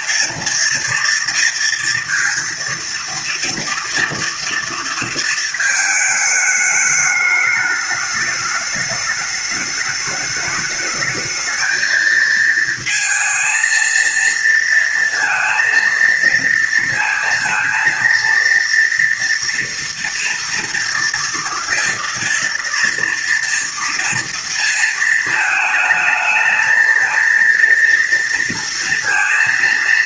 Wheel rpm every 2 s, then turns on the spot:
230, 230, 230, 210, 210, 210, 220, 230, 230, 230, 230, 230, 230, 220, 230.
none